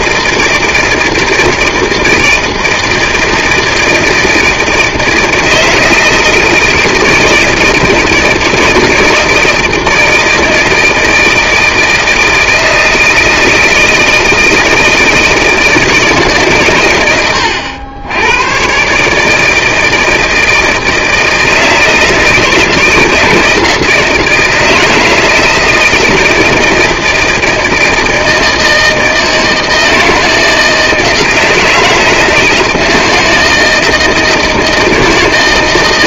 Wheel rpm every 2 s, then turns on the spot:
160, 160, 160, 160, 160, 160, 160, 160, 130, 120, 160, 160, 170, 160, 160, 160, 160, 170.
none